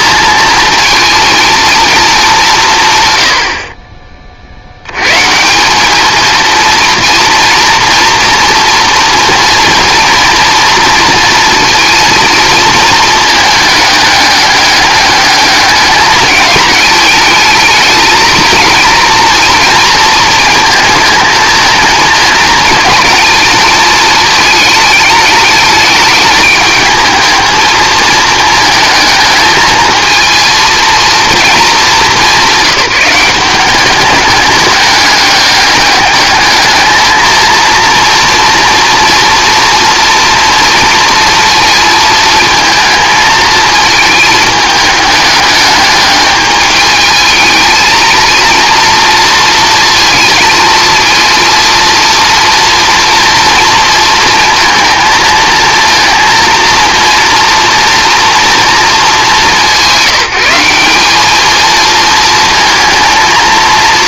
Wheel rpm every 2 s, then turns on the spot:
220, 160, 80, 230, 230, 230, 220, 210, 210, 230, 220, 220, 210, 210, 220, 230, 190, 200, 220, 230, 230, 230, 210, 210, 230, 220, 230, 230, 230, 220, 190, 230.
none